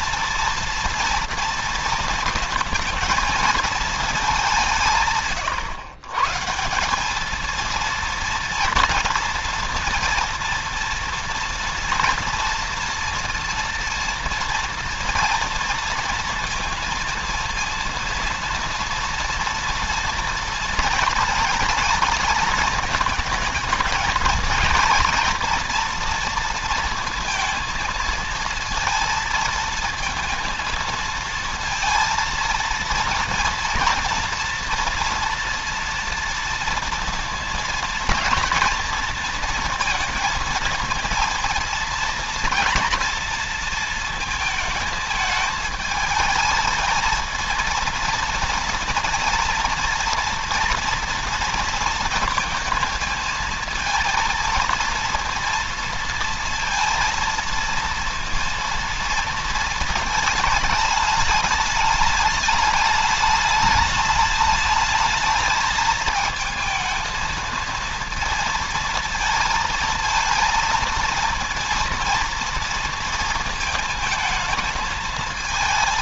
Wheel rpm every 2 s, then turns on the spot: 230, 230, 170, 170, 230, 230, 230, 230, 230, 230, 230, 220, 230, 230, 230, 230, 230, 240, 230, 230, 230, 230, 220, 220, 230, 230, 220, 230, 230, 230, 210, 210, 210, 220, 230, 230, 230, 220.
none